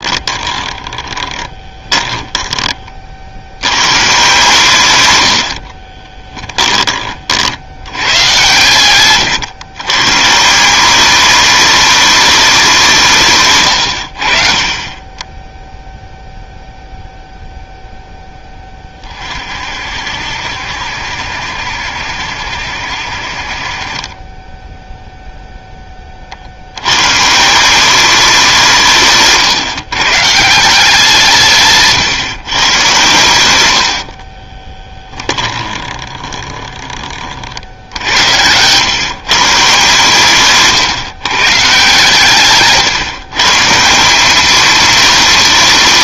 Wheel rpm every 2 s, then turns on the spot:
20, 20, 120, 30, 120, 190, 190, 30, 0, 20, 60, 60, 0, 100, 170, 180, 130, 20, 20, 130, 140, 140, 220.
0-2 34-36